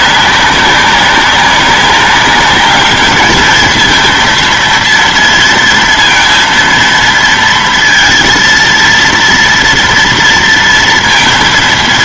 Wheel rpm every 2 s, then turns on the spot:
190, 210, 230, 230, 230, 230.
none